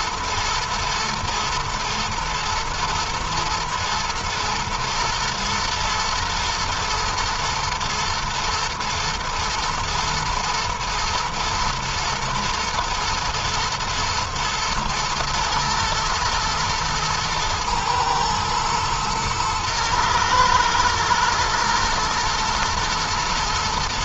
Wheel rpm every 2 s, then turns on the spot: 110, 120, 120, 110, 120, 120, 110, 120, 110, 110, 110, 110.
none